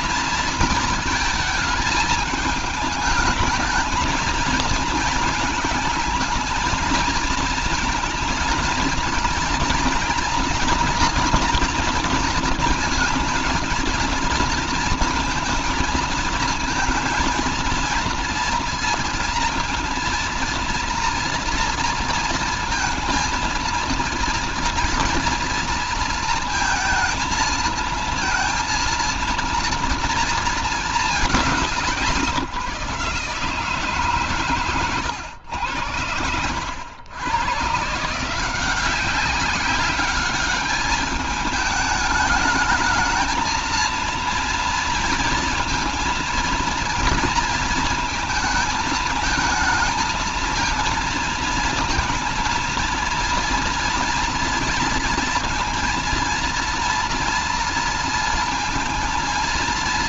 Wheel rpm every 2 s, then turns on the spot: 230, 210, 230, 230, 230, 230, 230, 230, 220, 230, 230, 230, 230, 230, 230, 220, 150, 120, 100, 180, 210, 220, 230, 230, 220, 230, 230, 230, 230, 230.
none